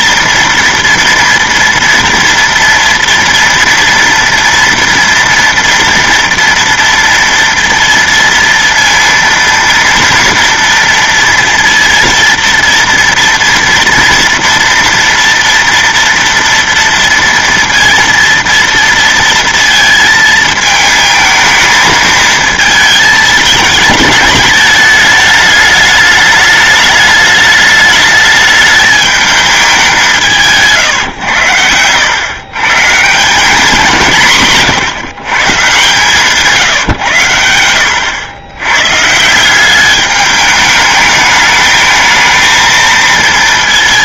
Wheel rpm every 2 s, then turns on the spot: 230, 230, 230, 230, 230, 240, 230, 230, 230, 230, 220, 220, 210, 210, 210, 160, 130, 150, 140, 100, 210, 220.
30-32